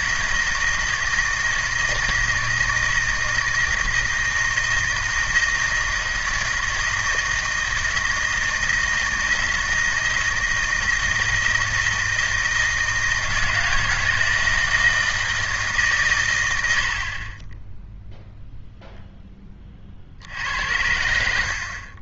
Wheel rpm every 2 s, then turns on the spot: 160, 160, 160, 160, 160, 160, 160, 160, 70, 0, 80.
none